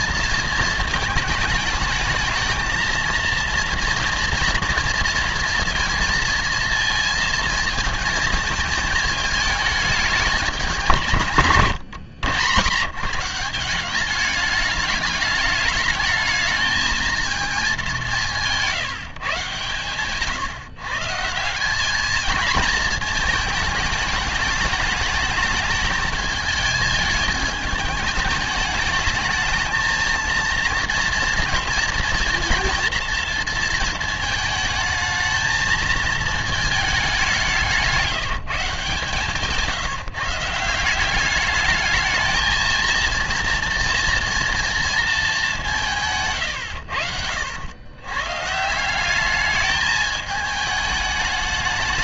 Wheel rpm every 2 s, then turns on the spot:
220, 220, 230, 230, 220, 210, 140, 210, 220, 170, 140, 220, 210, 220, 220, 230, 230, 220, 220, 170, 170, 230, 230, 120, 160, 210.
18-20